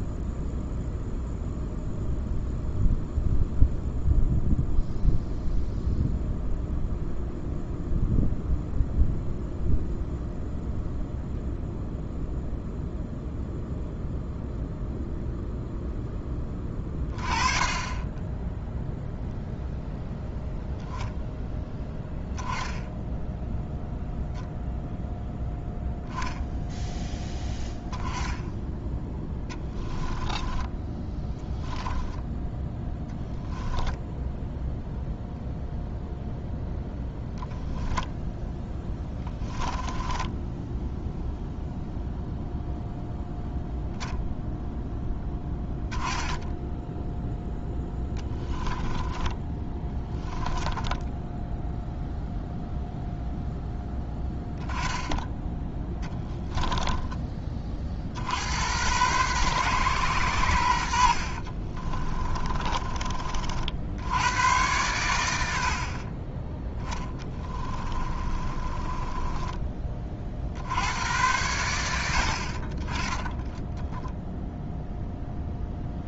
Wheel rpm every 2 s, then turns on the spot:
0, 0, 0, 0, 0, 0, 0, 0, 20, 0, 0, 10, 0, 0, 10, 10, 0, 0, 0, 10, 0, 0, 0, 0, 10, 10, 0, 10, 10, 100, 80, 30, 90, 10, 20, 90, 30, 0.
30-32 38-40 48-50 56-58 60-64 66-70